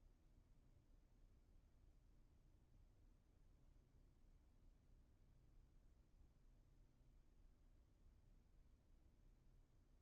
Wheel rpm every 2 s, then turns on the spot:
0, 0, 0, 0, 0.
none